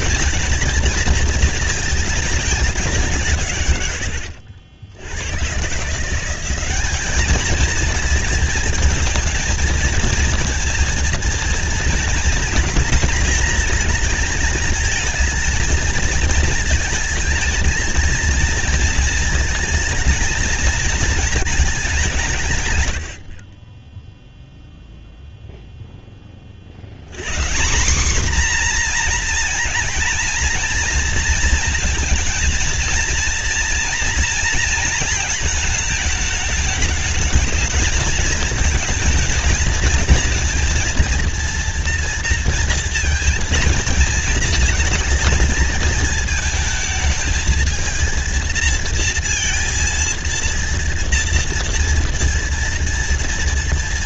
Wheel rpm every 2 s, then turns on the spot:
230, 190, 70, 200, 230, 230, 230, 220, 220, 230, 230, 120, 0, 70, 240, 230, 230, 230, 210, 220, 230, 230, 230, 220, 220, 230, 230.
none